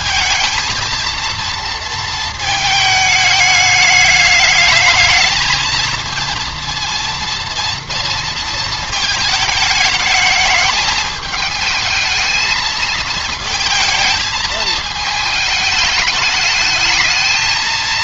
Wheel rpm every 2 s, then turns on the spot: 220, 220, 210, 230, 230, 220, 220, 220, 210.
none